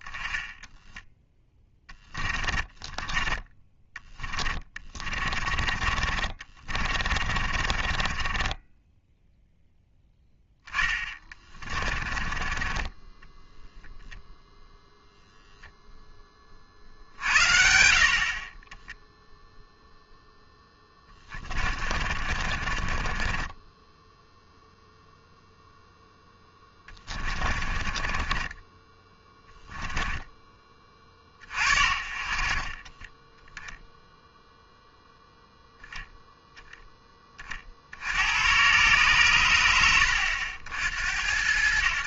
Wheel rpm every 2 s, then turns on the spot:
20, 40, 30, 0, 30, 0, 10, 50, 0, 40, 10, 0, 40, 10, 40, 10, 0, 10, 110, 80, 80.
0-6 8-10 18-22 24-28